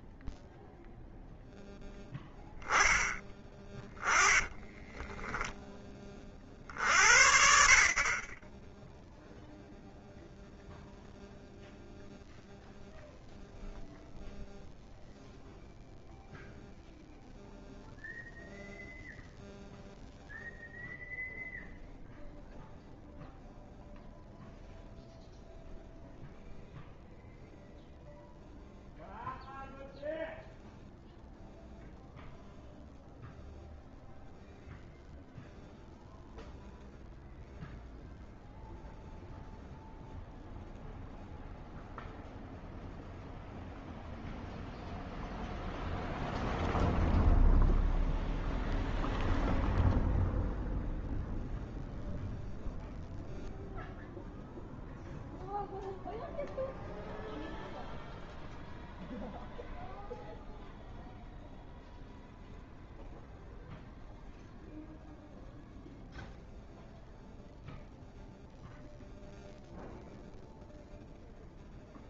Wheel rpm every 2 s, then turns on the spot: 0, 10, 10, 40, 0, 0, 0, 0, 0, 0, 0, 0, 0, 0, 0, 0, 0, 0, 0, 0, 0, 0, 0, 0, 0, 0, 0, 0, 0, 0, 0, 0, 0, 0, 0, 0.
none